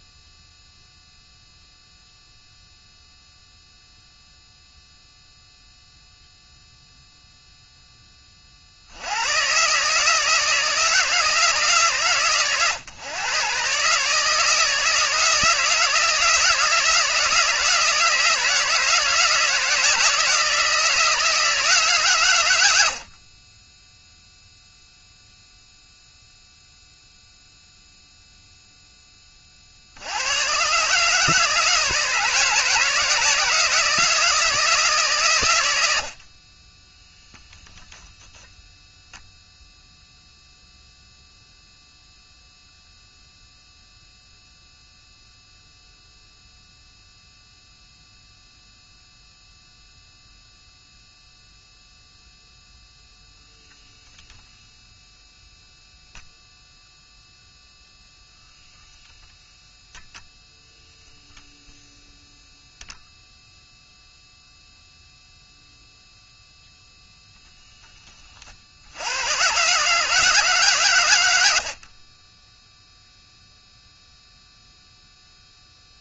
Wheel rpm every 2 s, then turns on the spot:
0, 0, 0, 0, 50, 160, 120, 160, 160, 160, 160, 100, 0, 0, 0, 110, 160, 160, 30, 0, 0, 0, 0, 0, 0, 0, 0, 0, 0, 0, 0, 0, 0, 0, 60, 140, 0, 0.
none